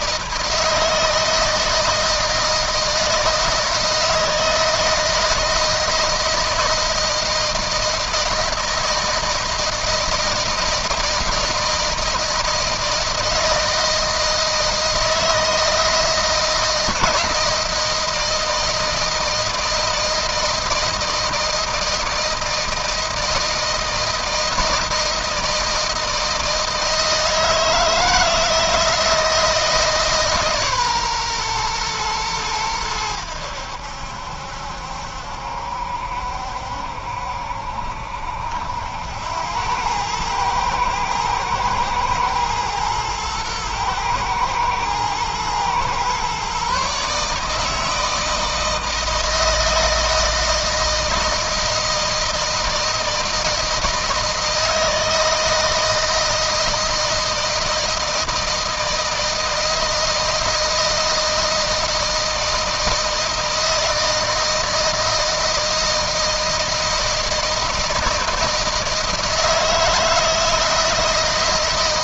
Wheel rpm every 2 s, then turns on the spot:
160, 160, 160, 160, 160, 160, 160, 160, 170, 160, 160, 160, 160, 160, 160, 140, 90, 70, 70, 90, 110, 110, 110, 140, 160, 160, 160, 160, 160, 160, 160, 160, 160, 160, 160, 160.
none